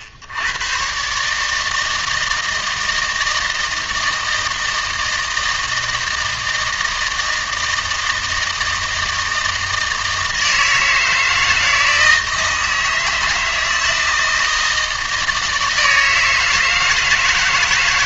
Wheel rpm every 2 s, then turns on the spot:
80, 160, 160, 160, 160, 160, 160, 160, 160.
none